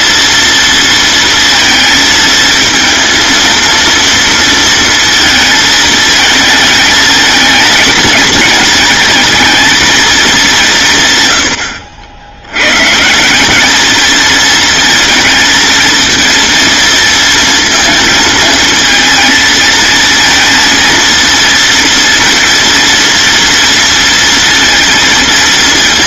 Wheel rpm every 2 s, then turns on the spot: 230, 230, 230, 220, 220, 150, 150, 220, 230, 230, 230, 240, 230.
none